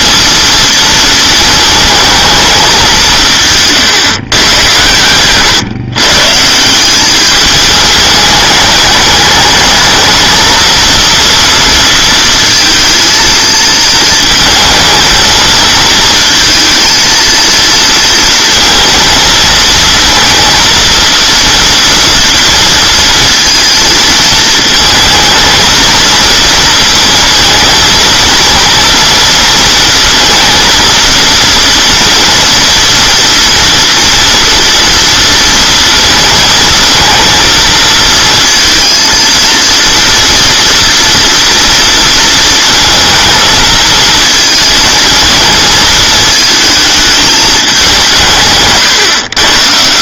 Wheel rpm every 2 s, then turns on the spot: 230, 200, 110, 170, 210, 230, 230, 220, 230, 230, 230, 230, 220, 230, 230, 230, 240, 230, 230, 230, 230, 230, 230, 220, 150.
none